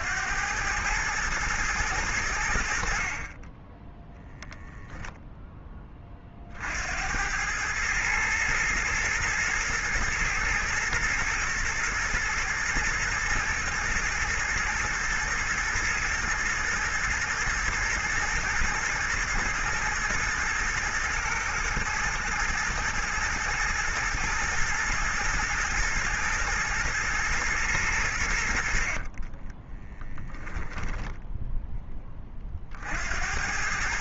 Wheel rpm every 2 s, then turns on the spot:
100, 50, 0, 70, 110, 120, 110, 110, 120, 120, 120, 120, 120, 110, 50, 10, 60.
28-32